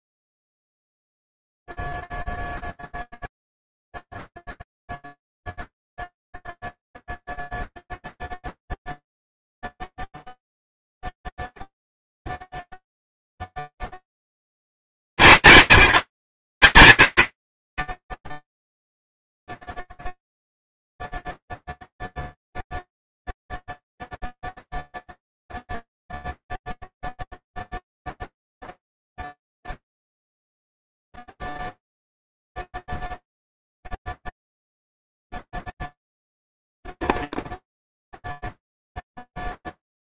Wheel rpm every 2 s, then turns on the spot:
0, 0, 0, 0, 0, 0, 0, 40, 170, 10, 0, 0, 0, 0, 0, 0, 0, 0, 0, 0.
none